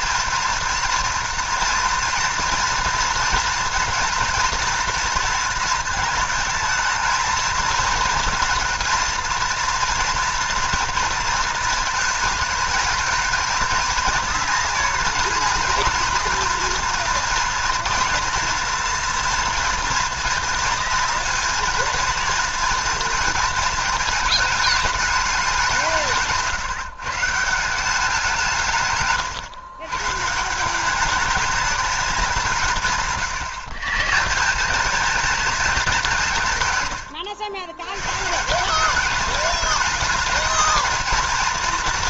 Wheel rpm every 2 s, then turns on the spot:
230, 230, 240, 220, 230, 230, 220, 230, 230, 230, 230, 230, 220, 150, 150, 180, 160, 190, 130, 190, 220.
36-38